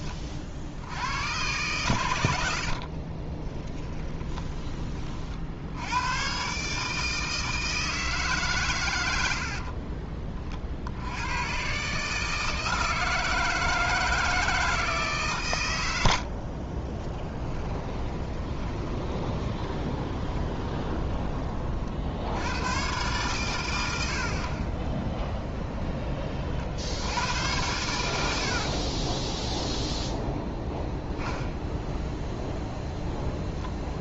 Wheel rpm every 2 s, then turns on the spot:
50, 60, 30, 150, 110, 50, 160, 160, 30, 20, 20, 110, 10, 50, 50, 0, 0.
2-4 16-22 28-30